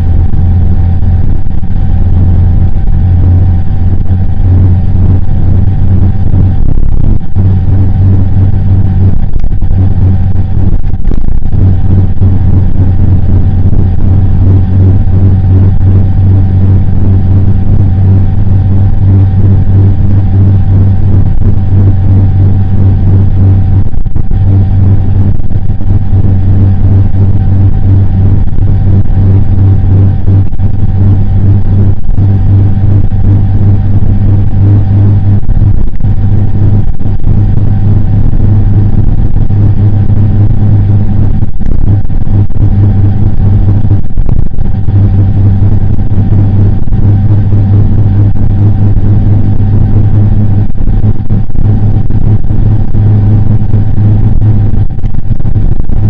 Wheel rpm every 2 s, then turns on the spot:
0, 0, 0, 0, 0, 0, 0, 0, 0, 0, 0, 0, 0, 0, 0, 0, 0, 0, 0, 0, 0, 0, 0, 0, 0, 0, 0, 0.
none